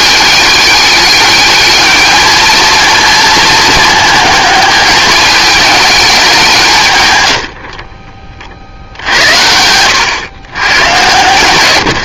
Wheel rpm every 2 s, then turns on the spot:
210, 220, 210, 110, 70, 110.
none